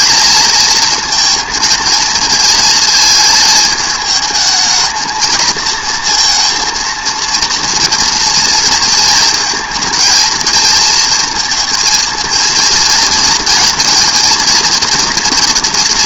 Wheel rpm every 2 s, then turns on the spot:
230, 220, 220, 230, 230, 230, 230, 230.
none